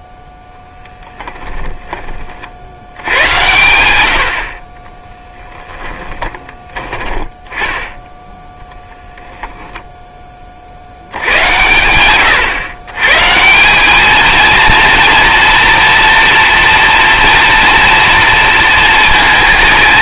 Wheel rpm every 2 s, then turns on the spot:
10, 60, 40, 20, 10, 60, 110, 230, 230, 230.
0-2